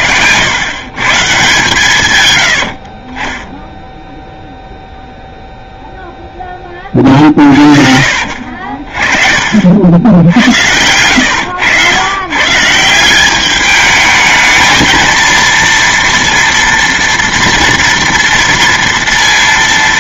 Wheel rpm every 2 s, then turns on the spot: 120, 70, 0, 10, 40, 100, 150, 220, 230, 230.
2-4